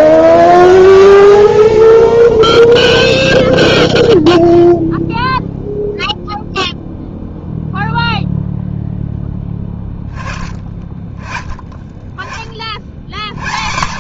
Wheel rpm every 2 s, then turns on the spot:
0, 0, 0, 0, 0, 30, 50.
none